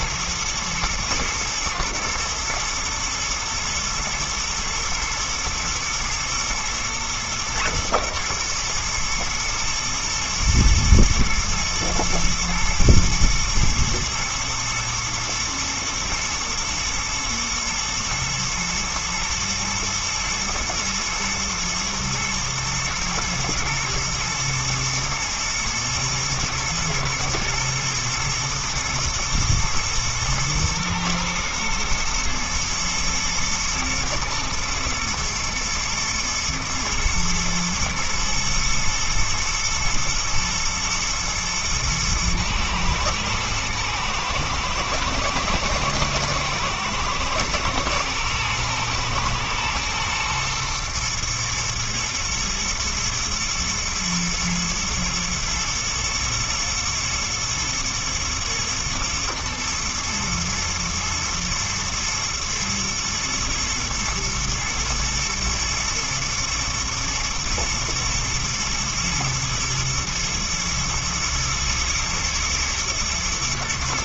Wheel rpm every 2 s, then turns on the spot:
120, 110, 120, 120, 110, 110, 110, 110, 120, 120, 120, 110, 110, 110, 110, 110, 110, 120, 120, 120, 120, 110, 110, 110, 120, 120, 110, 110, 110, 110, 110, 110, 120, 110, 110, 110, 110.
none